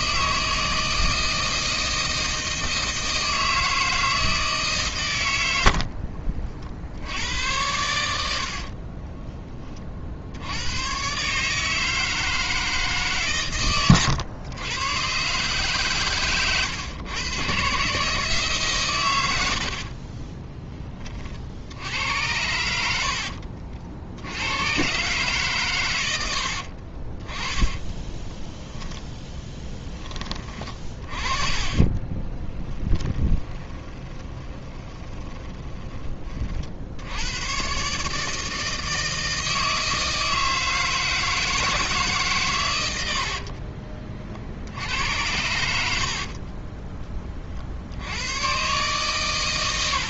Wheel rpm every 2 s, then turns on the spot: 160, 160, 150, 60, 60, 90, 160, 110, 120, 150, 20, 90, 100, 60, 20, 30, 10, 20, 50, 160, 160, 130, 60, 30, 120.
20-22 26-36 46-48